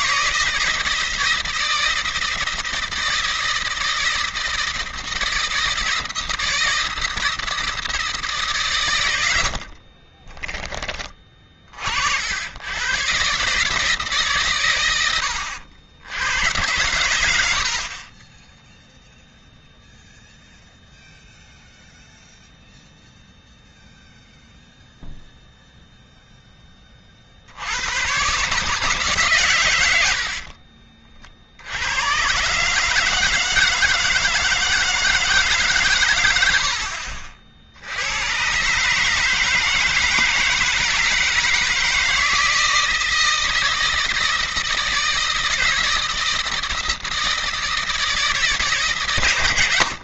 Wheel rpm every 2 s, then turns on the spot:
160, 160, 170, 160, 150, 20, 100, 130, 100, 10, 0, 0, 0, 10, 140, 50, 140, 170, 80, 130, 160, 160, 160, 160, 160.
30-32